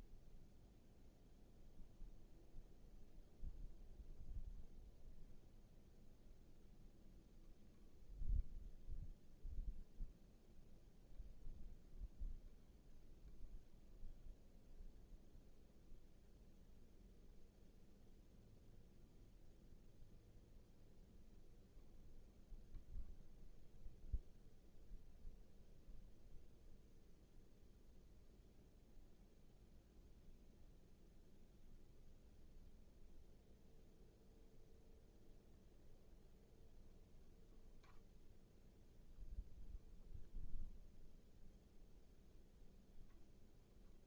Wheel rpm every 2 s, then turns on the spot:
0, 0, 0, 0, 0, 0, 0, 0, 0, 0, 0, 0, 0, 0, 0, 0, 0, 0, 0, 0, 0, 0.
none